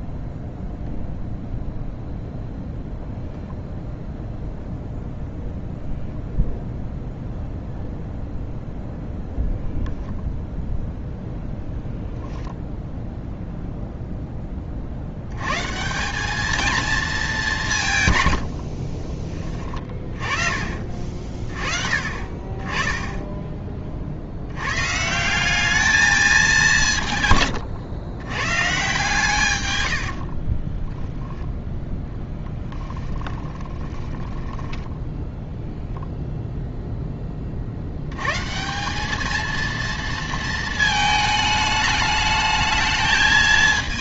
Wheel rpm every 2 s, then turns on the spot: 0, 0, 0, 0, 0, 0, 0, 40, 220, 60, 40, 20, 120, 170, 130, 10, 10, 10, 0, 180, 220, 220.
18-20 30-36